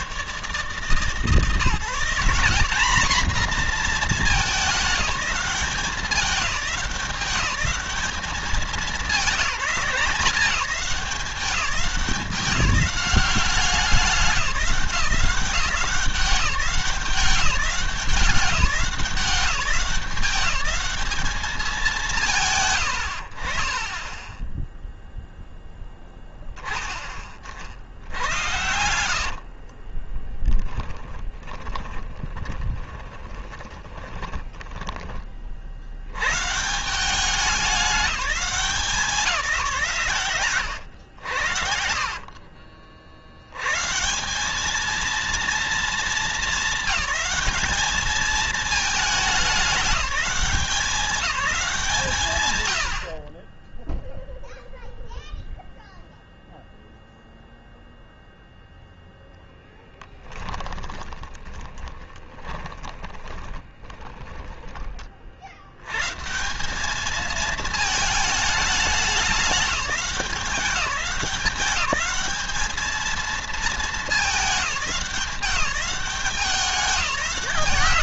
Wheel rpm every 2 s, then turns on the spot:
150, 210, 200, 170, 210, 180, 180, 190, 190, 190, 190, 150, 0, 20, 90, 10, 10, 20, 150, 180, 110, 50, 200, 200, 210, 190, 130, 0, 0, 0, 10, 20, 20, 170, 210, 190, 210, 200, 200.
28-36 42-44 60-66